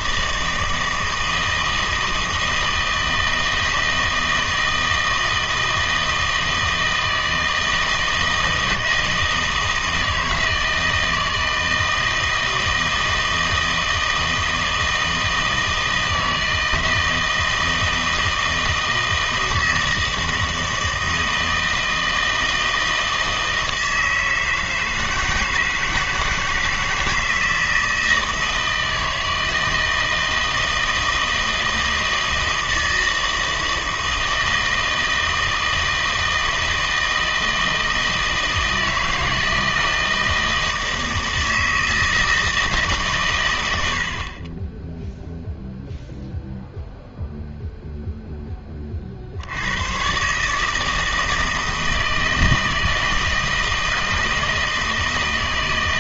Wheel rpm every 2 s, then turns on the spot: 160, 160, 160, 160, 160, 160, 160, 160, 160, 160, 160, 160, 160, 160, 160, 160, 160, 160, 160, 160, 160, 160, 20, 0, 20, 150, 160, 160.
none